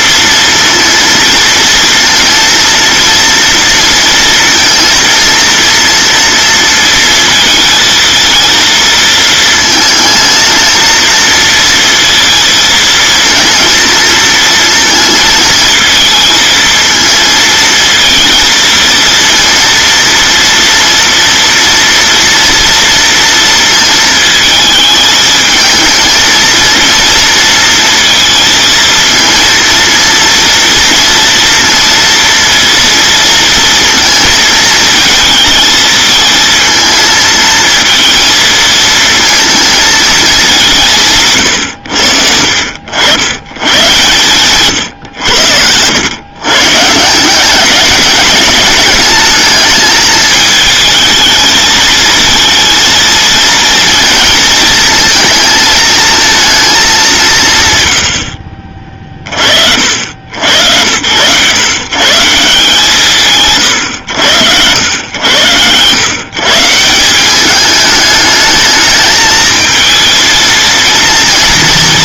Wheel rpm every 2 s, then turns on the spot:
230, 230, 230, 230, 230, 220, 220, 230, 220, 230, 230, 230, 220, 230, 230, 230, 230, 220, 220, 220, 190, 70, 120, 140, 210, 210, 230, 220, 210, 30, 100, 170, 90, 160, 210, 230.
44-46